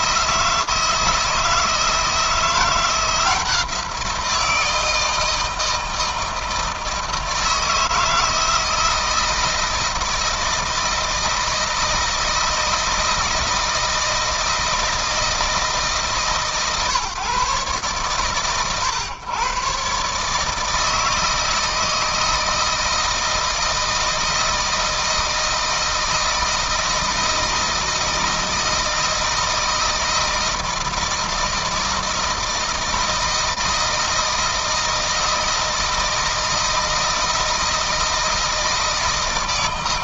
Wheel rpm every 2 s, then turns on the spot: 160, 170, 170, 160, 160, 160, 160, 160, 140, 120, 160, 160, 160, 160, 160, 160, 160, 160, 160, 160.
none